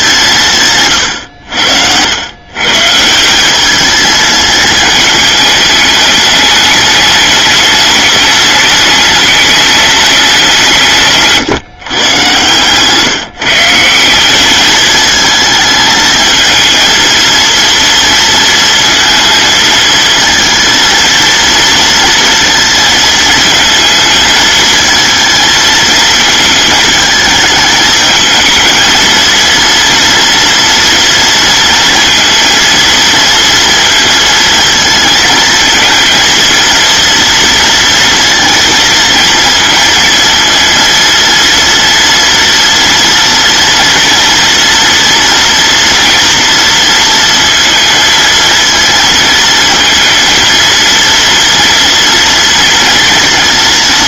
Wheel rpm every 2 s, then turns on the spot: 130, 140, 220, 210, 210, 180, 140, 210, 220, 230, 220, 230, 220, 220, 220, 230, 230, 230, 240, 230, 230, 230, 230, 230, 230, 230, 230.
0-2